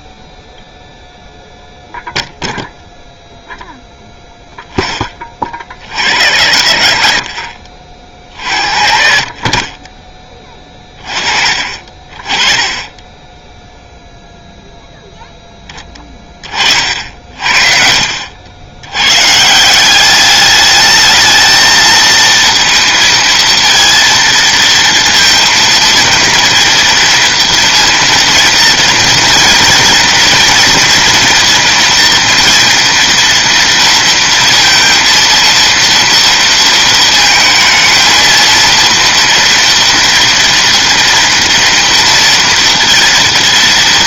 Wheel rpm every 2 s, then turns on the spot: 0, 0, 20, 60, 60, 30, 20, 0, 50, 110, 220, 230, 230, 230, 230, 230, 230, 230, 220, 230, 230, 230.
none